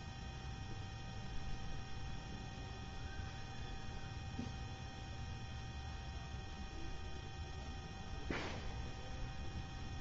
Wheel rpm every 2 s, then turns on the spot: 0, 0, 0, 0, 0.
none